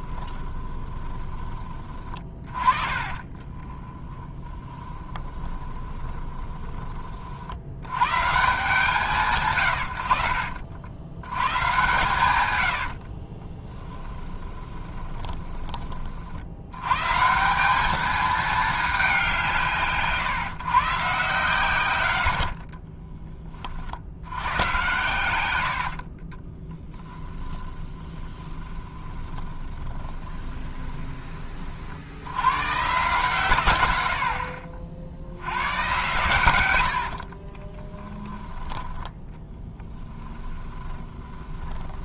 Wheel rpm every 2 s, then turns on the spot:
20, 40, 10, 20, 160, 60, 90, 20, 100, 210, 140, 30, 110, 20, 20, 20, 120, 50, 100, 10, 20.
0-6 12-16 22-24 26-32 36-38 40-42